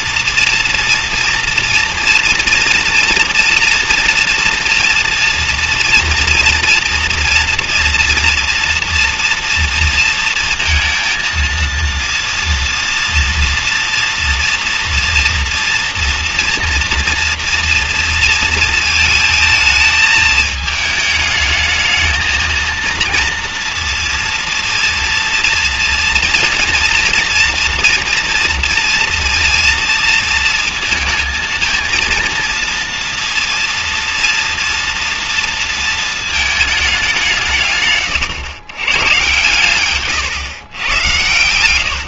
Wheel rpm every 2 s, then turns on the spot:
230, 230, 230, 230, 230, 230, 230, 230, 230, 230, 220, 220, 230, 230, 230, 230, 230, 240, 220, 120, 120.
none